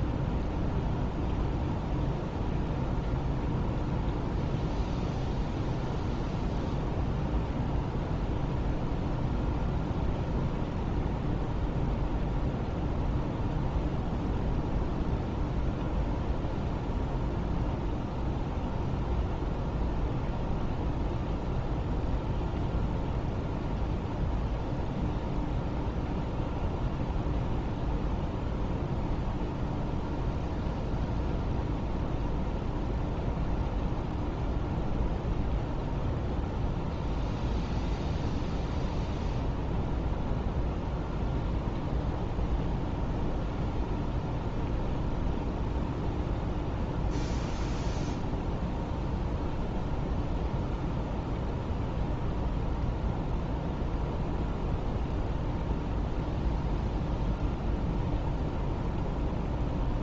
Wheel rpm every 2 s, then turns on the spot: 0, 0, 0, 0, 0, 0, 0, 0, 0, 0, 0, 0, 0, 0, 0, 0, 0, 0, 0, 0, 0, 0, 0, 0, 0, 0, 0, 0, 0, 0.
none